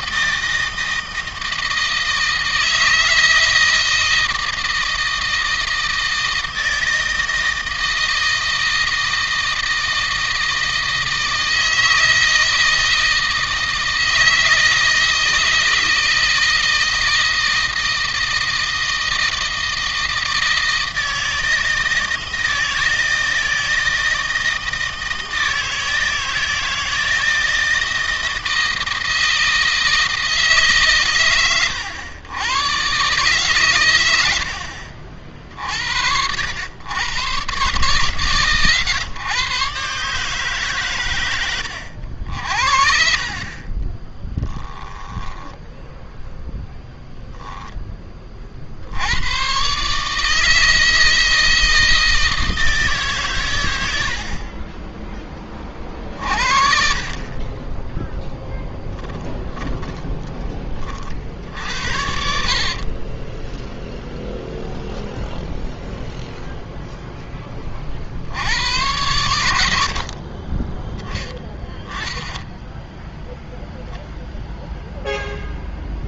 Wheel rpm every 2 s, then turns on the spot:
160, 160, 160, 160, 160, 160, 160, 160, 160, 160, 160, 160, 160, 160, 160, 130, 130, 50, 110, 130, 120, 50, 10, 10, 80, 160, 140, 20, 40, 10, 50, 20, 0, 10, 90, 20, 0, 0.
46-48 58-60 62-64